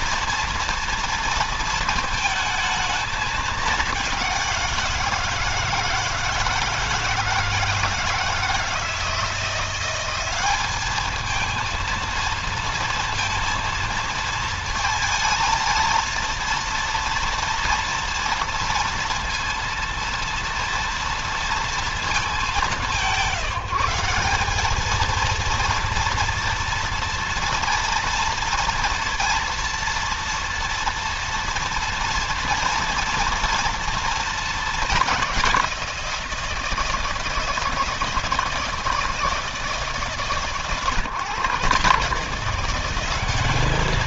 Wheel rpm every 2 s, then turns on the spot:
230, 210, 170, 160, 160, 210, 230, 220, 230, 230, 230, 180, 220, 230, 230, 230, 230, 210, 160, 160, 130, 190.
none